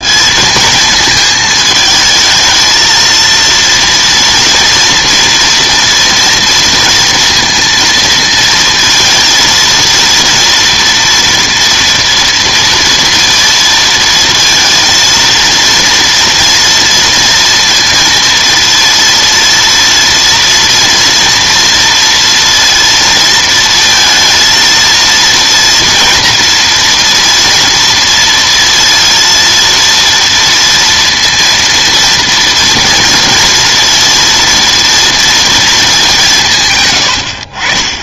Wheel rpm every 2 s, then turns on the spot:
220, 220, 230, 230, 230, 230, 230, 230, 230, 230, 230, 230, 230, 230, 230, 230, 230, 230, 150.
none